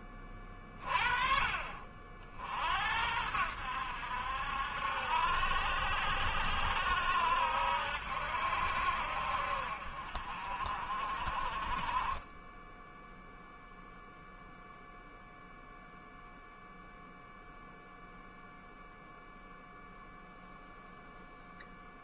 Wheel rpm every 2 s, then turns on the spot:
30, 70, 70, 70, 70, 40, 10, 0, 0, 0, 0.
none